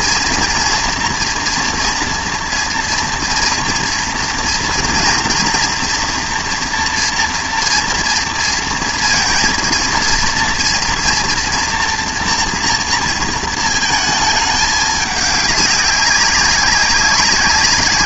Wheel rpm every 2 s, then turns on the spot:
240, 230, 230, 230, 230, 240, 240, 210, 190.
none